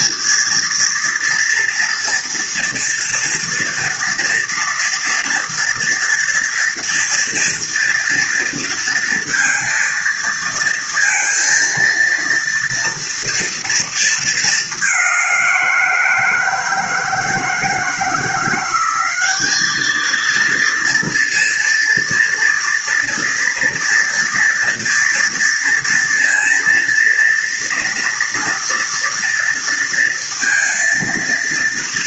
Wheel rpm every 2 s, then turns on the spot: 230, 230, 230, 230, 230, 230, 230, 210, 170, 180, 230, 230, 230, 230, 230, 230.
none